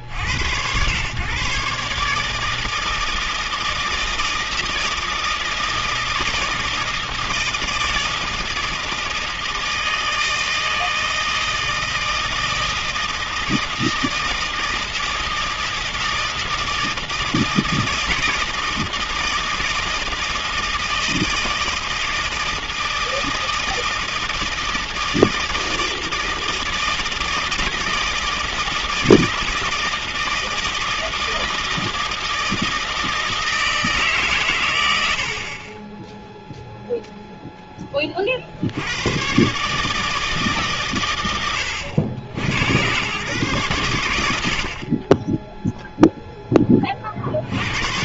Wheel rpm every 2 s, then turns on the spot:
60, 150, 160, 160, 160, 160, 160, 160, 160, 160, 160, 160, 160, 160, 160, 160, 160, 80, 0, 90, 120, 100, 40, 20.
none